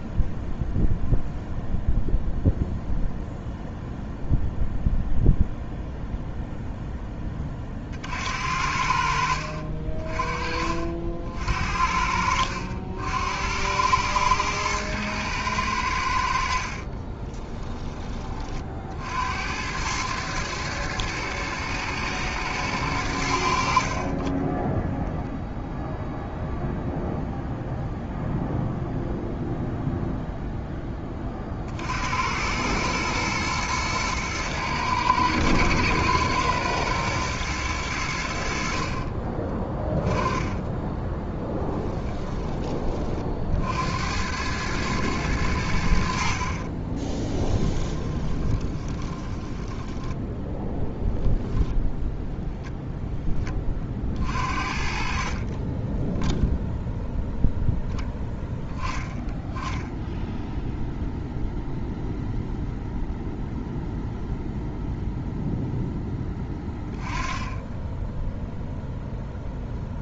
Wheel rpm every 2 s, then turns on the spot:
0, 0, 0, 0, 60, 50, 70, 110, 50, 50, 110, 100, 10, 0, 0, 20, 110, 110, 120, 50, 20, 20, 110, 40, 20, 0, 0, 50, 0, 10, 0, 0, 0, 10, 0.
16-18 40-42 46-50